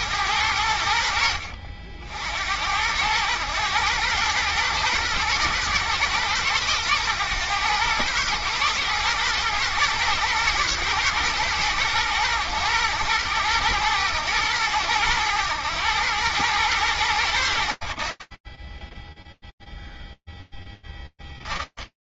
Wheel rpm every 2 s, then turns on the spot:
60, 110, 110, 110, 110, 110, 110, 110, 60, 0, 10.
none